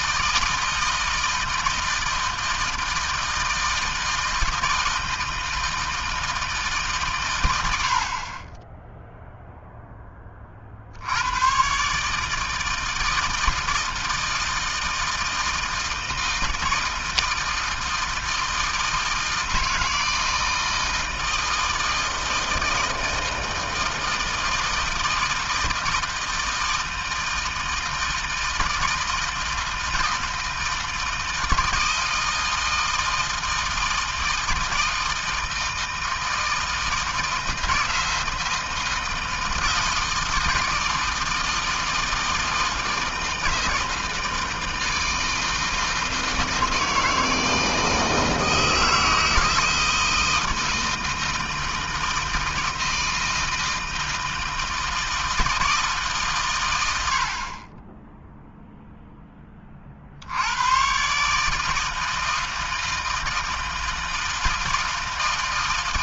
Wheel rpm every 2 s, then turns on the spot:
160, 160, 160, 120, 0, 80, 160, 160, 160, 160, 160, 160, 160, 160, 160, 160, 160, 160, 160, 160, 160, 160, 160, 160, 160, 160, 160, 160, 70, 10, 140, 160, 160.
none